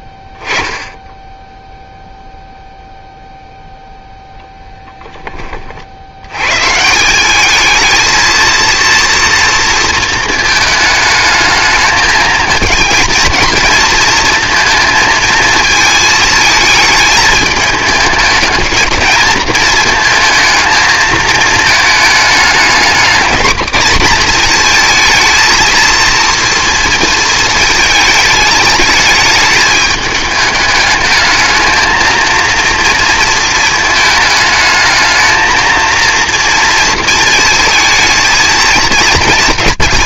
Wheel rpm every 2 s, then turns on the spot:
10, 0, 10, 140, 230, 220, 220, 230, 220, 210, 220, 210, 230, 230, 210, 210, 230, 220, 230, 230.
none